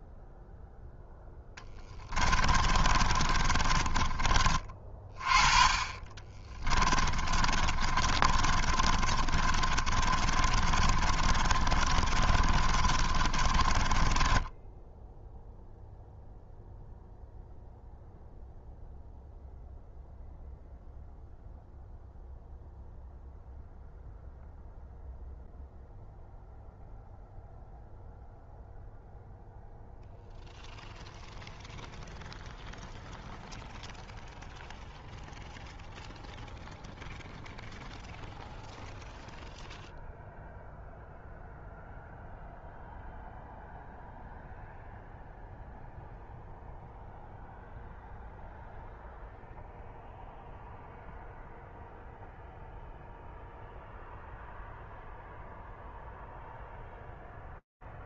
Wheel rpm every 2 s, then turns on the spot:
0, 20, 30, 30, 40, 30, 30, 10, 0, 0, 0, 0, 0, 0, 0, 0, 0, 0, 0, 0, 0, 0, 0, 0, 0, 0, 0, 0, 0.
2-4 6-16